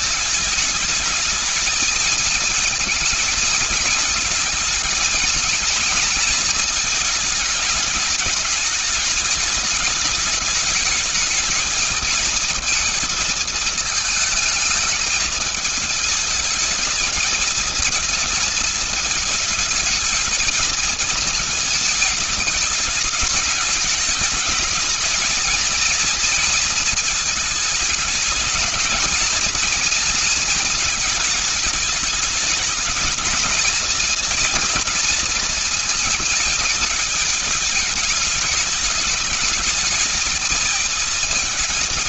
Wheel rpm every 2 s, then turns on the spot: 220, 230, 220, 210, 210, 210, 220, 220, 220, 220, 220, 210, 210, 230, 220, 220, 220, 230, 220, 210, 220.
none